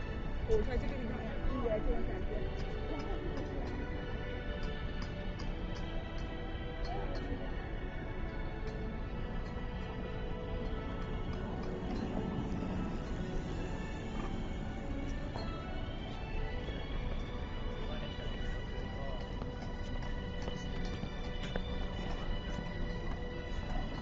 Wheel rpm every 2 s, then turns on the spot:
0, 0, 0, 0, 0, 0, 0, 0, 0, 0, 0, 0.
none